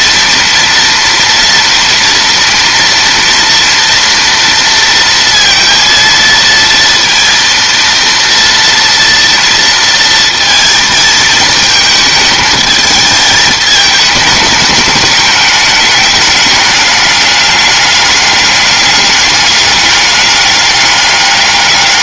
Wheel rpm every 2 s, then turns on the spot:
230, 230, 230, 230, 230, 230, 210, 210, 210, 200, 200.
none